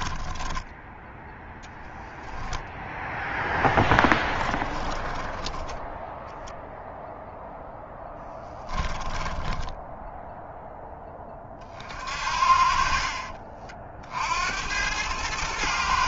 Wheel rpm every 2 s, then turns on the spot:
0, 0, 20, 0, 10, 20, 40, 110.
4-6 8-10